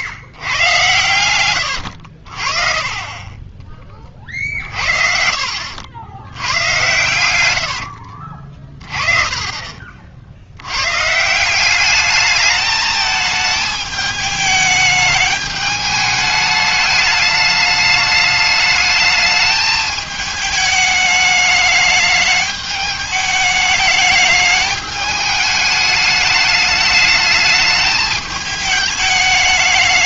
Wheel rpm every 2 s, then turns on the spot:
110, 30, 50, 80, 30, 100, 220, 210, 210, 210, 210, 210, 210, 210, 210.
6-8